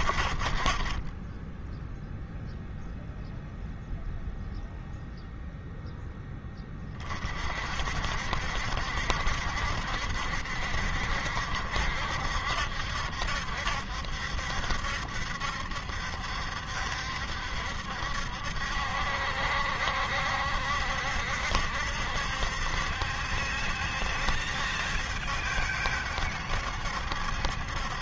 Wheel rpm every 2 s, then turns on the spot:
40, 0, 0, 20, 70, 70, 70, 70, 70, 70, 70, 70, 70, 70.
none